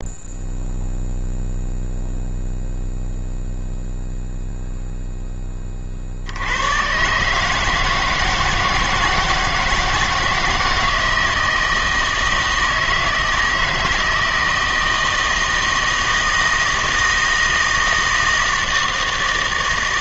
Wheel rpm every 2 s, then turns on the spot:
0, 0, 0, 100, 160, 170, 160, 160, 160, 160.
none